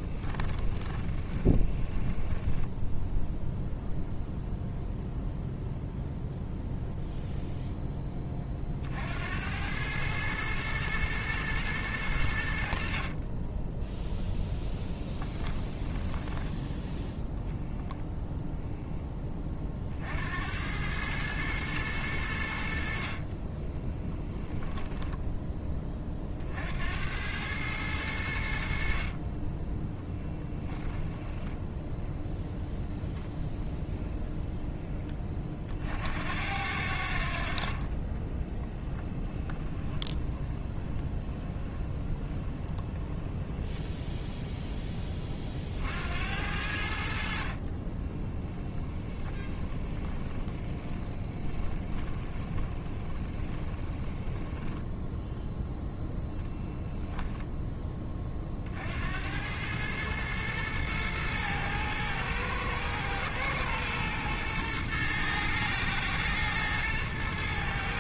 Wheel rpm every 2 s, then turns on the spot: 10, 10, 0, 0, 50, 110, 50, 10, 10, 0, 100, 60, 0, 70, 60, 10, 0, 10, 70, 10, 20, 20, 20, 70, 10, 20, 20, 10, 0, 70, 110, 110, 120, 110.
0-4 14-16 30-32 38-44 48-54